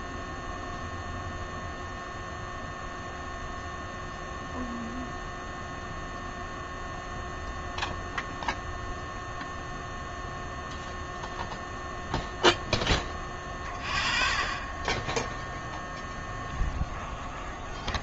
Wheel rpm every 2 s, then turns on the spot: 0, 0, 0, 0, 0, 0, 0, 0, 0.
none